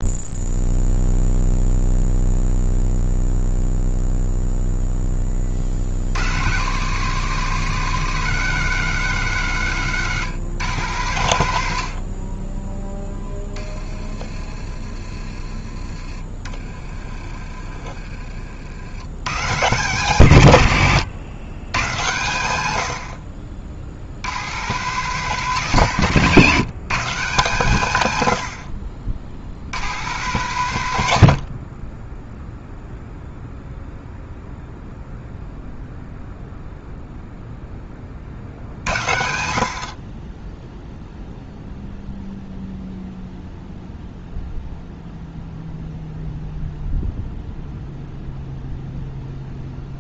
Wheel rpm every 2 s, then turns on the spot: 0, 0, 0, 110, 190, 150, 40, 30, 30, 50, 120, 90, 120, 150, 70, 140, 0, 0, 0, 50, 10, 0, 0, 0, 0.
16-18